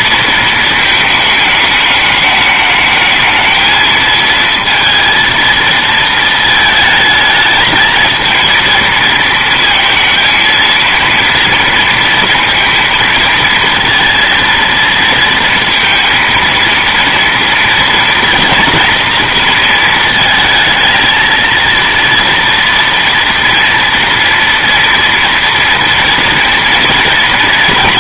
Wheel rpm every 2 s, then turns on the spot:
220, 210, 230, 220, 220, 230, 230, 230, 230, 230, 220, 240, 230, 230.
none